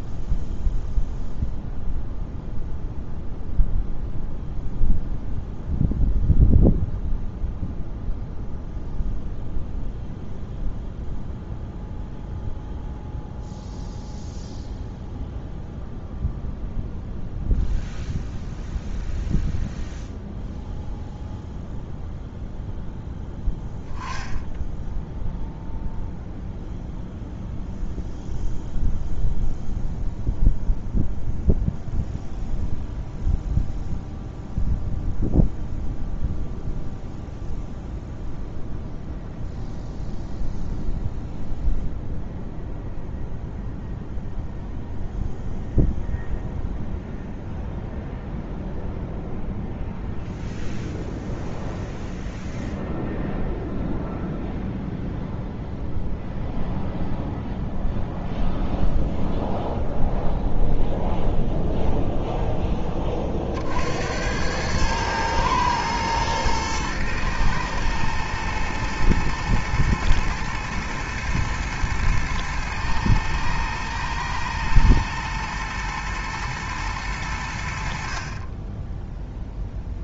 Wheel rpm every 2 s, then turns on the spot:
0, 0, 0, 0, 0, 0, 0, 0, 0, 0, 0, 0, 0, 0, 0, 0, 0, 0, 0, 0, 0, 0, 0, 0, 0, 0, 0, 0, 0, 0, 0, 0, 90, 110, 110, 110, 110, 120, 110, 40.
none